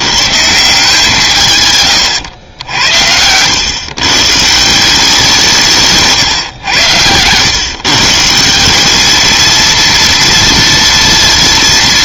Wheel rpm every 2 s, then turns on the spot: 160, 90, 160, 120, 170, 230.
none